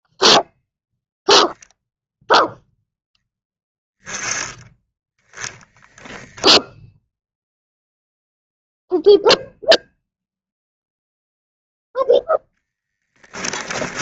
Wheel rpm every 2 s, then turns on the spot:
0, 0, 20, 10, 0, 0, 30.
12-14